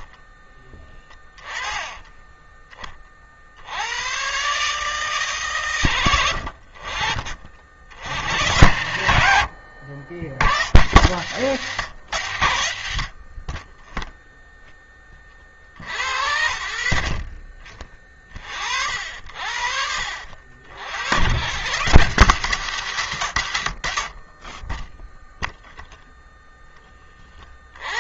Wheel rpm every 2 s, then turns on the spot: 30, 20, 120, 80, 100, 90, 120, 0, 60, 50, 70, 140, 40, 0.
0-2